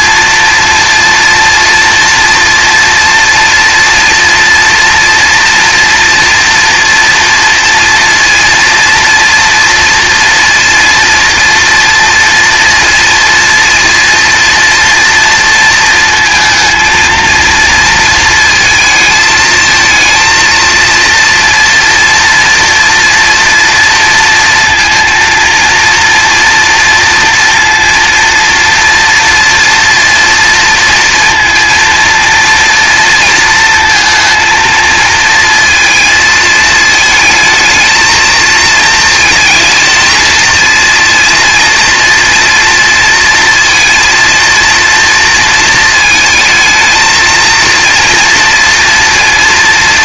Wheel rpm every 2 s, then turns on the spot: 230, 230, 230, 230, 230, 230, 230, 230, 220, 220, 230, 230, 230, 230, 230, 230, 230, 230, 220, 230, 230, 230, 230, 220, 230.
none